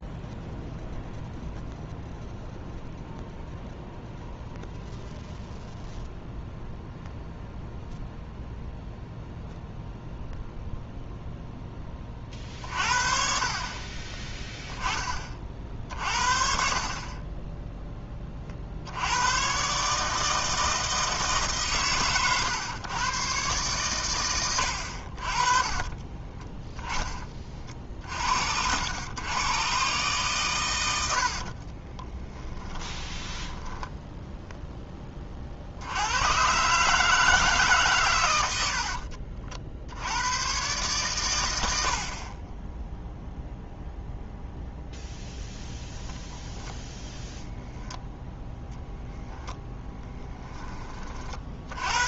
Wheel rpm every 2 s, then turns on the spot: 0, 0, 0, 0, 0, 0, 50, 20, 30, 70, 160, 130, 60, 20, 90, 110, 10, 20, 160, 70, 120, 10, 0, 10, 10, 40.
24-26 32-34 38-40 48-50